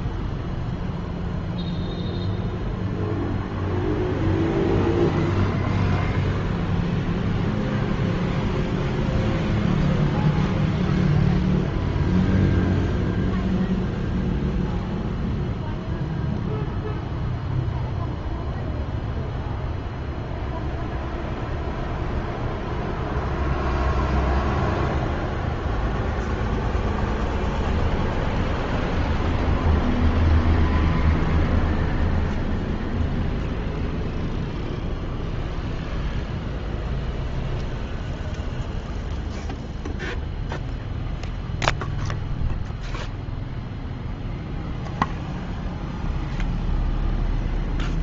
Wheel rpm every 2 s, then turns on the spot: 0, 0, 0, 0, 0, 0, 0, 0, 0, 0, 0, 0, 0, 0, 0, 0, 0, 0, 0, 0, 0, 0, 0, 0.
none